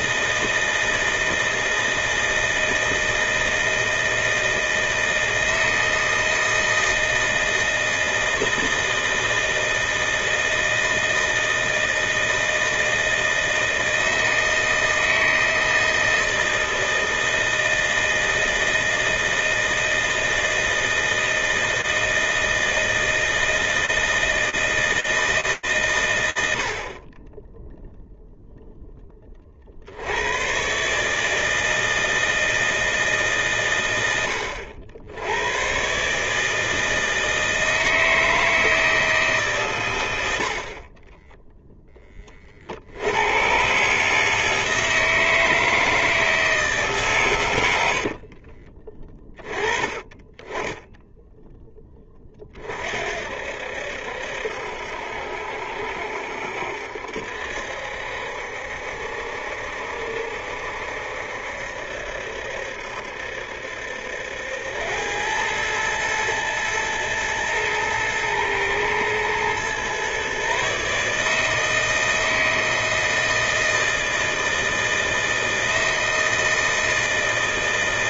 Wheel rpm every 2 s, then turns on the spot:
160, 160, 160, 160, 160, 160, 160, 160, 160, 160, 160, 160, 160, 30, 0, 130, 160, 90, 160, 160, 50, 80, 160, 140, 20, 10, 60, 70, 70, 70, 70, 70, 90, 110, 120, 140, 160, 160, 160.
none